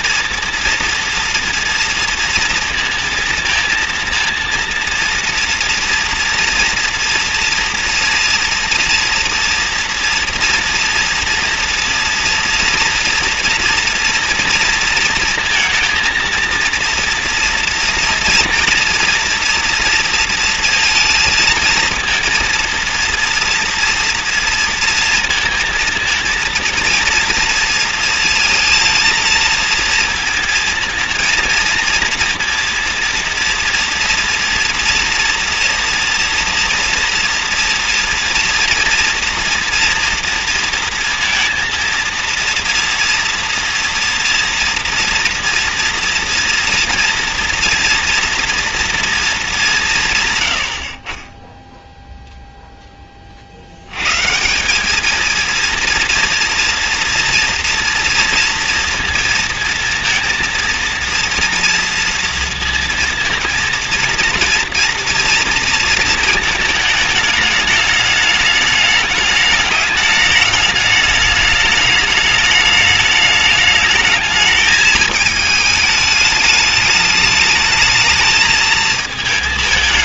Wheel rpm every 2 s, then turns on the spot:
230, 230, 230, 230, 230, 230, 230, 230, 230, 230, 230, 230, 230, 230, 230, 230, 230, 230, 230, 230, 230, 230, 230, 230, 230, 70, 0, 180, 230, 230, 230, 230, 230, 220, 210, 210, 210, 220, 210, 220.
none